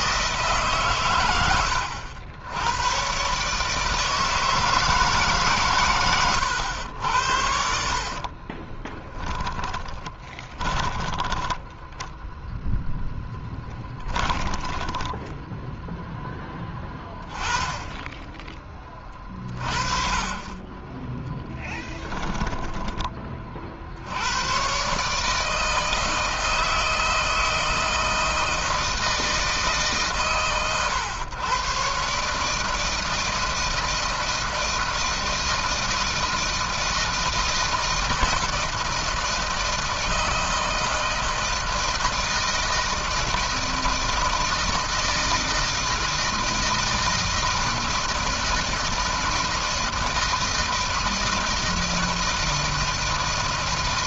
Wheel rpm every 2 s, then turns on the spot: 140, 100, 160, 90, 30, 20, 0, 20, 10, 20, 20, 10, 110, 160, 160, 110, 150, 160, 160, 160, 160, 160, 160, 160, 160, 160, 160.
8-12 14-16